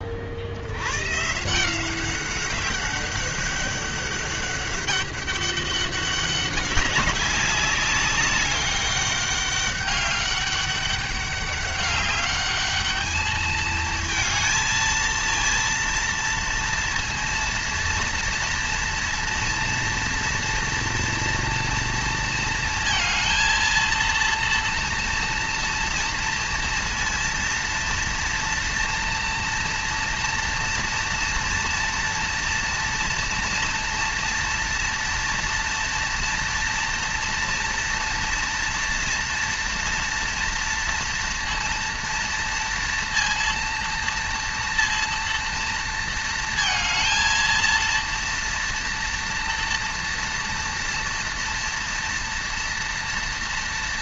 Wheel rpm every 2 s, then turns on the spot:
140, 200, 200, 200, 200, 200, 210, 230, 230, 230, 230, 230, 230, 230, 230, 230, 230, 230, 230, 230, 230, 230, 230, 220, 240, 230, 230.
none